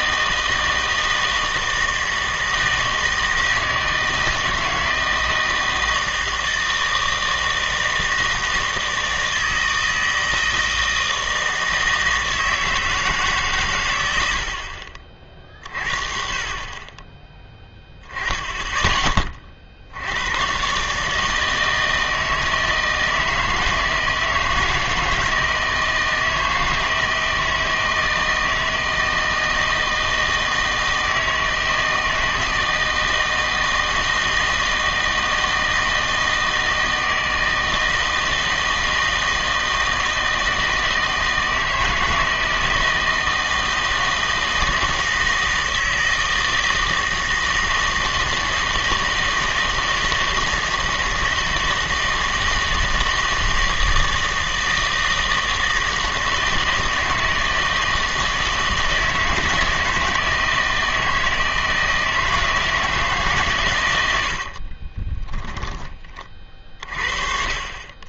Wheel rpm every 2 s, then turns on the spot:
160, 160, 160, 160, 160, 160, 160, 70, 30, 10, 120, 160, 160, 160, 160, 160, 160, 160, 160, 160, 160, 160, 160, 160, 160, 160, 160, 160, 160, 160, 160, 160, 50, 40.
64-66